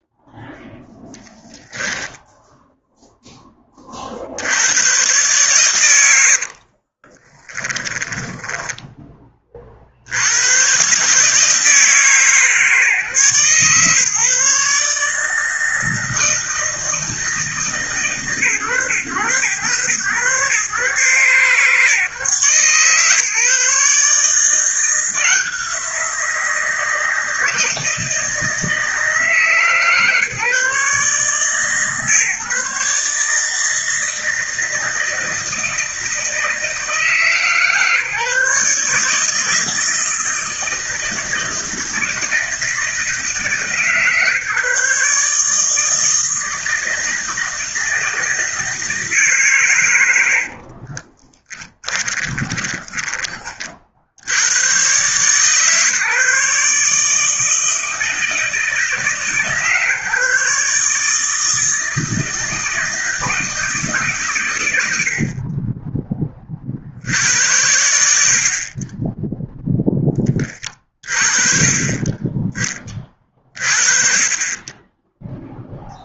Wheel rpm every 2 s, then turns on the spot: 0, 0, 120, 30, 20, 140, 140, 150, 160, 110, 140, 140, 170, 160, 160, 150, 150, 160, 160, 160, 160, 150, 140, 160, 160, 40, 20, 130, 150, 150, 150, 160, 80, 80, 20, 30, 30, 10.
6-8 50-52